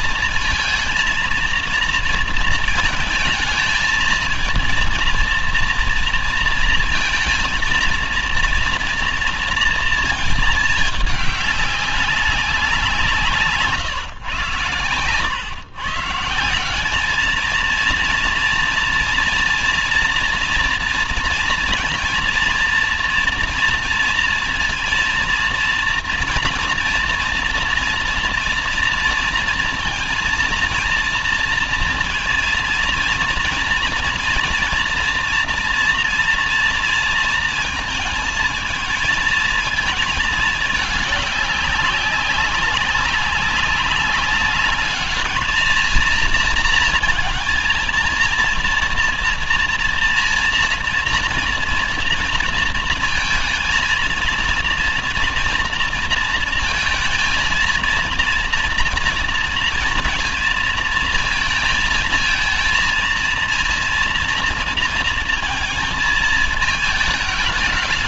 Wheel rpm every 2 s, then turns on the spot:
230, 230, 220, 230, 230, 220, 190, 110, 170, 230, 230, 230, 230, 230, 230, 230, 230, 230, 230, 220, 220, 200, 200, 230, 230, 230, 230, 230, 230, 230, 230, 230, 230, 220.
none